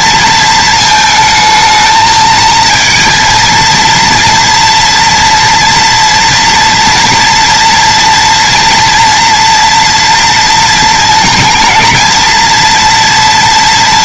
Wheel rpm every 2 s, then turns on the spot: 230, 220, 230, 230, 240, 230, 230.
none